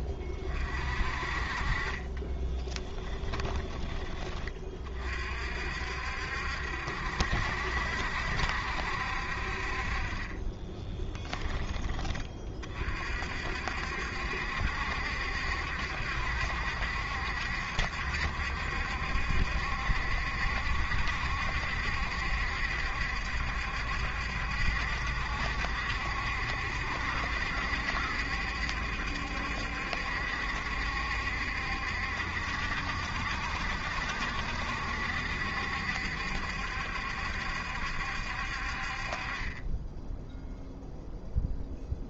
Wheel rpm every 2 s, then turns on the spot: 40, 20, 30, 70, 60, 20, 50, 70, 70, 70, 70, 70, 70, 70, 70, 70, 70, 70, 70, 40, 0.
2-4 10-12